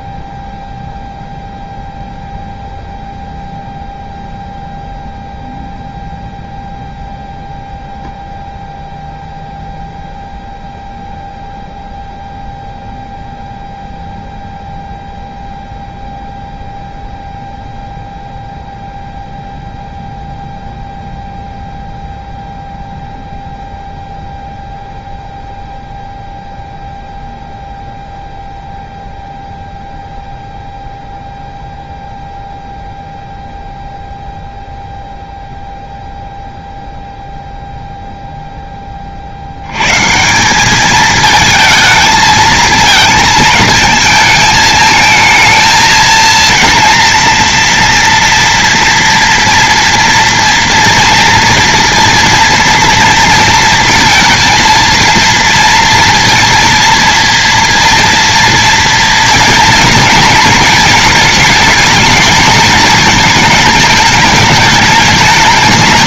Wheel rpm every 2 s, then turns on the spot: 0, 0, 0, 0, 0, 0, 0, 0, 0, 0, 0, 0, 0, 0, 0, 0, 0, 0, 0, 30, 210, 220, 220, 230, 240, 230, 230, 230, 230, 230, 220, 220, 210.
none